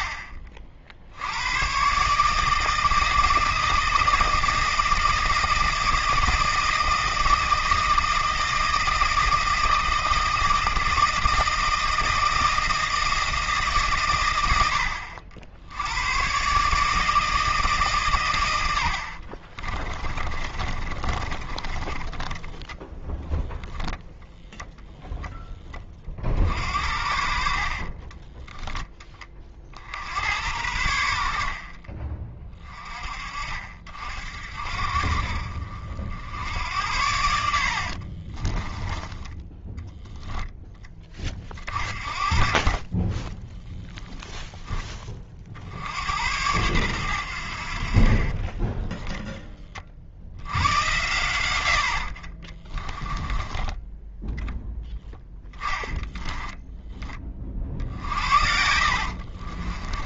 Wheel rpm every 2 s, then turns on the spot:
60, 160, 160, 160, 160, 160, 160, 80, 150, 80, 30, 0, 0, 60, 10, 80, 30, 60, 80, 20, 10, 30, 10, 100, 20, 80, 10, 10, 10, 70.
20-22 26-28 38-40 48-50 52-54 58-60